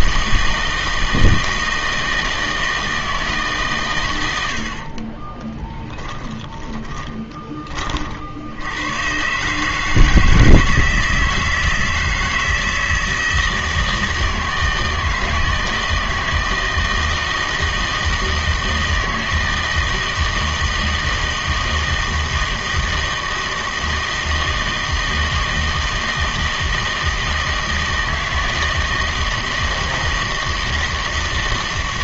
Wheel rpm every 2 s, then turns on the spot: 160, 160, 70, 20, 90, 160, 160, 160, 160, 160, 160, 160, 160, 160, 160, 160.
6-8